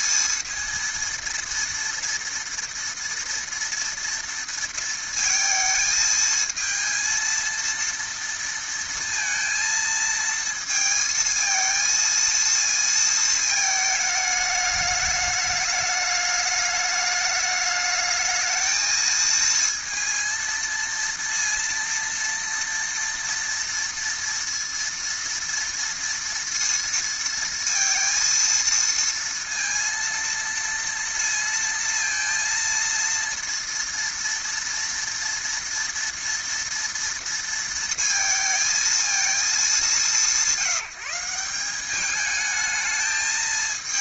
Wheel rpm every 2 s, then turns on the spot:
230, 230, 230, 220, 230, 220, 230, 210, 210, 220, 230, 230, 230, 230, 230, 230, 230, 230, 230, 230, 180, 210.
none